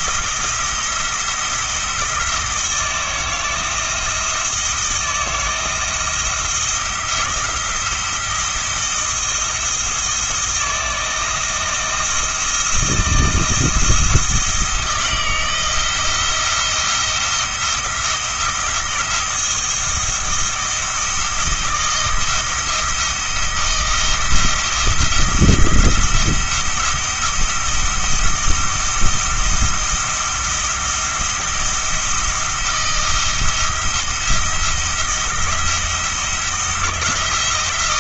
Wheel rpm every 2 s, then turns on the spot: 170, 160, 170, 170, 170, 170, 170, 160, 170, 170, 170, 170, 170, 170, 170, 170, 170, 170, 170.
none